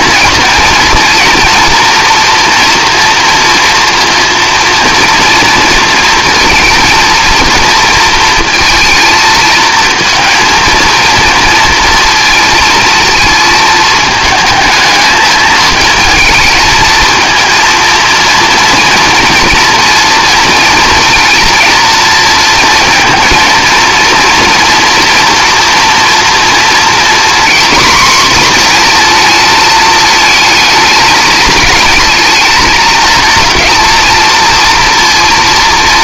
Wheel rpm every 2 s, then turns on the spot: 230, 230, 230, 230, 230, 230, 230, 220, 220, 230, 230, 220, 240, 240, 240, 220, 220, 230.
none